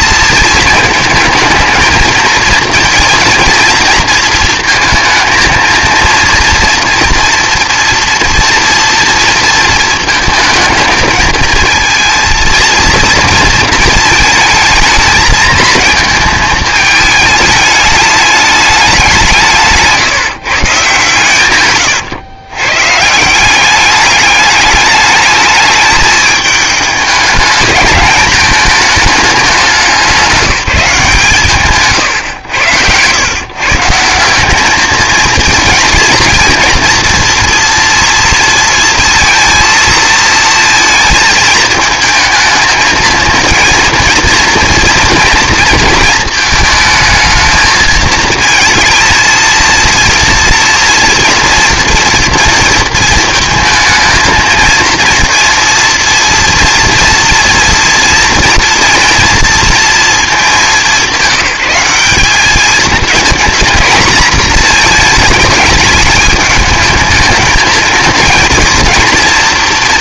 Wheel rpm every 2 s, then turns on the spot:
220, 230, 230, 230, 230, 230, 230, 220, 220, 210, 150, 120, 210, 210, 220, 190, 120, 200, 230, 230, 230, 220, 230, 220, 220, 230, 230, 220, 230, 230, 210, 210, 230, 220, 230.
none